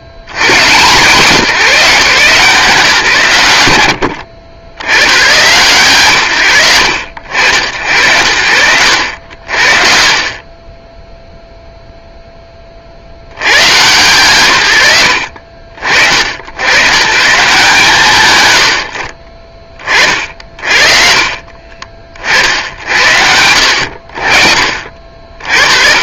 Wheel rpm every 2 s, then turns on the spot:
100, 150, 80, 130, 70, 30, 10, 130, 110, 120, 50, 50, 50.
4-6